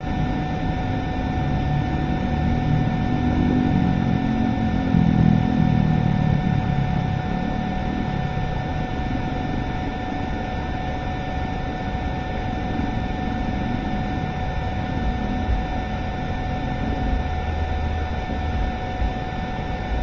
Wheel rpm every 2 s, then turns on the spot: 0, 0, 0, 0, 0, 0, 0, 0, 0, 0.
none